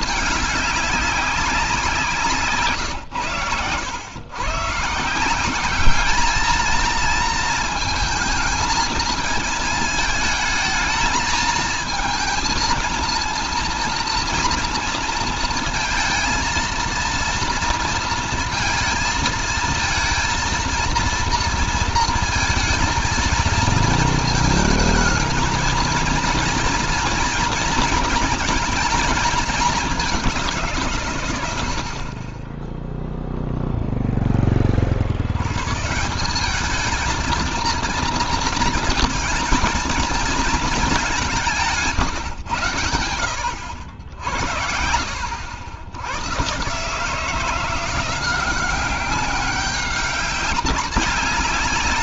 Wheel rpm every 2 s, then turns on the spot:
200, 150, 140, 220, 220, 220, 230, 230, 230, 230, 230, 220, 220, 230, 230, 170, 20, 40, 210, 230, 220, 110, 60, 140, 190, 190.
none